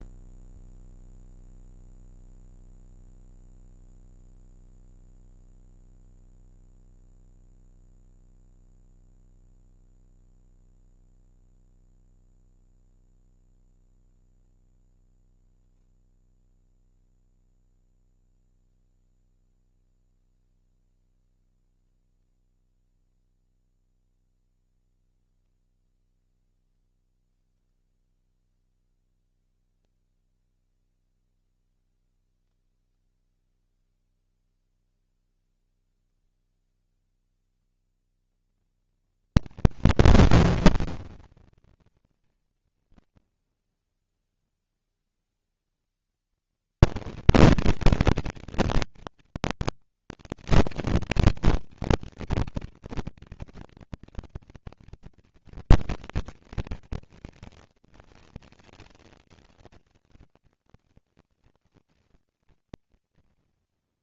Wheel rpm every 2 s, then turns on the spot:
60, 70, 60, 70, 70, 70, 70, 70, 70, 20, 10, 0, 10, 10, 10, 40, 90, 150, 190, 230, 230, 230, 230, 230, 230, 240, 230, 230, 230, 230, 230, 230.
18-22 26-30